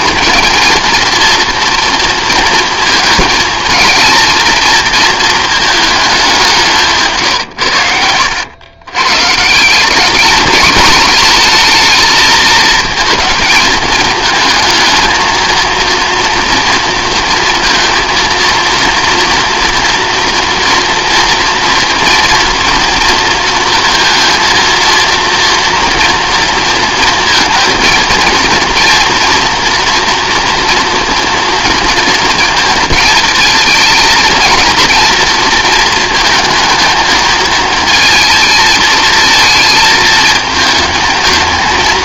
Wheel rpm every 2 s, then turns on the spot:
230, 230, 230, 160, 110, 210, 230, 220, 230, 230, 230, 230, 230, 230, 230, 240, 230, 230, 230, 220, 220.
none